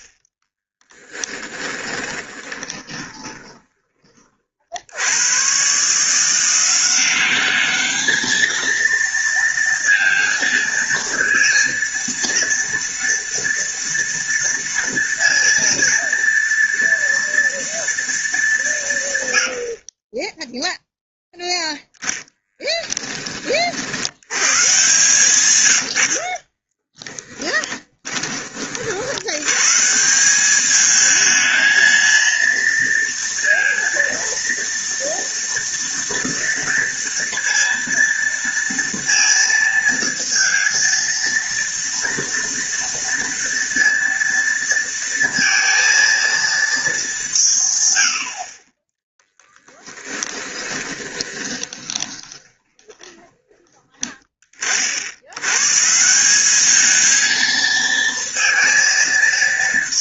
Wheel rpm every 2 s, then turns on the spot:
30, 20, 40, 170, 220, 230, 230, 230, 230, 200, 10, 10, 110, 30, 30, 200, 230, 230, 230, 230, 230, 230, 230, 230, 40, 10, 20, 30, 190, 230.
0-4 22-24 26-28 50-54